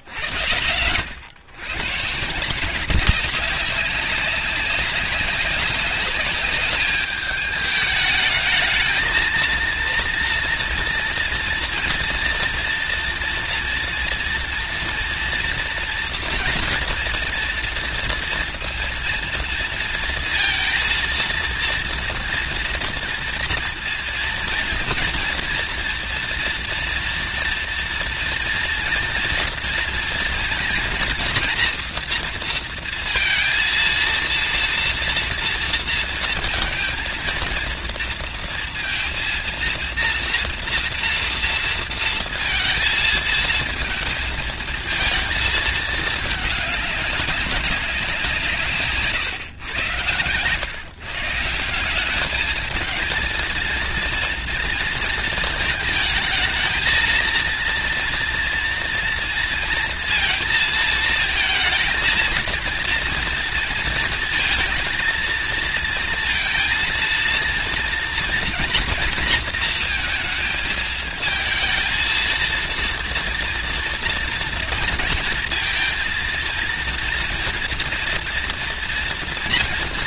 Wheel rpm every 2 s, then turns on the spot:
120, 160, 190, 200, 220, 230, 240, 230, 240, 230, 230, 230, 230, 230, 230, 230, 230, 230, 230, 230, 230, 230, 220, 210, 170, 120, 210, 230, 220, 240, 230, 230, 230, 230, 230, 220, 230, 230, 230, 240.
none